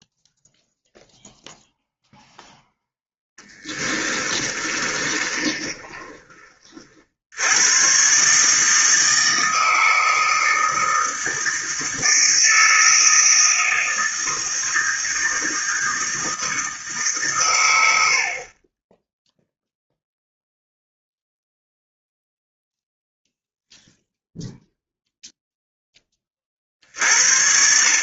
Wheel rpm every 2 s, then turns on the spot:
0, 10, 30, 50, 160, 160, 160, 160, 160, 30, 0, 0, 0, 40.
4-6